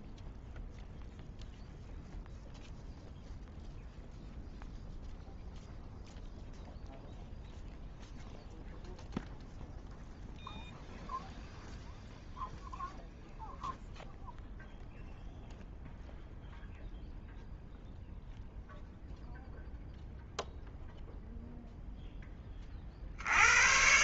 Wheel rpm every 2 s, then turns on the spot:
0, 0, 0, 0, 0, 0, 0, 0, 0, 0, 0, 10.
none